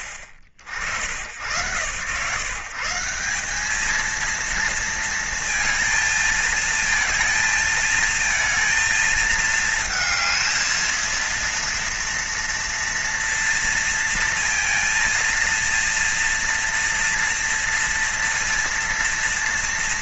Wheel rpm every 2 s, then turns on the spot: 50, 160, 230, 230, 220, 220, 230, 230, 230, 230.
none